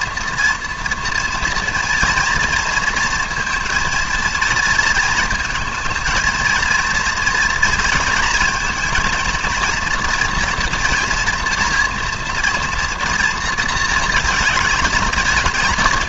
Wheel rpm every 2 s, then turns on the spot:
230, 230, 230, 230, 230, 230, 240, 220.
none